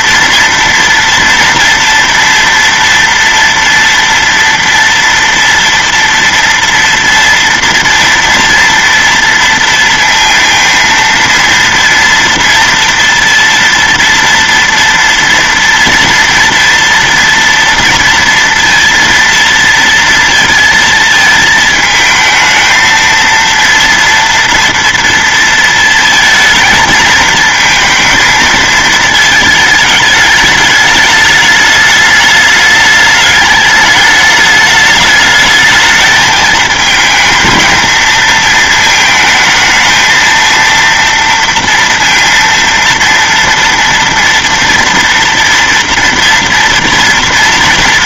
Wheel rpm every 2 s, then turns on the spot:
230, 230, 230, 230, 230, 230, 230, 230, 230, 230, 220, 220, 230, 230, 220, 210, 210, 210, 220, 220, 230, 230, 230, 230.
none